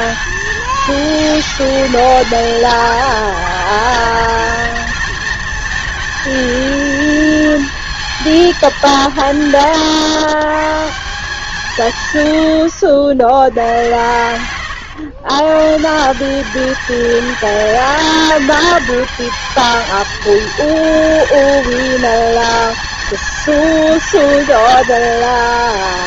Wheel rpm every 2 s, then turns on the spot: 220, 220, 220, 230, 190, 140, 80, 110, 210, 220, 230, 220, 210.
none